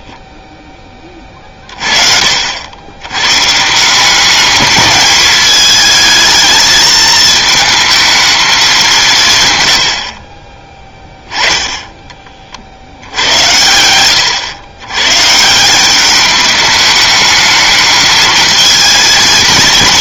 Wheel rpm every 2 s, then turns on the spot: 10, 70, 210, 220, 200, 20, 50, 110, 210, 220.
none